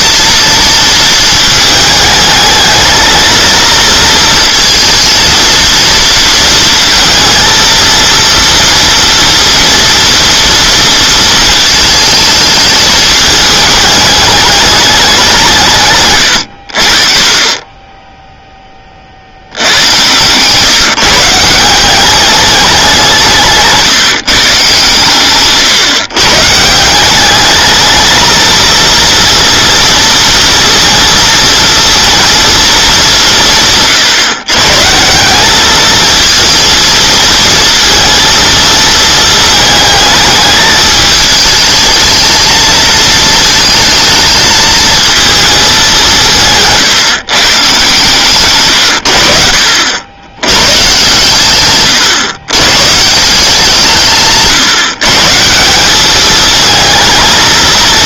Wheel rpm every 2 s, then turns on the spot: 230, 220, 230, 230, 230, 230, 220, 210, 50, 20, 150, 180, 140, 180, 230, 230, 210, 150, 230, 220, 210, 220, 230, 150, 130, 120, 140, 140, 220.
none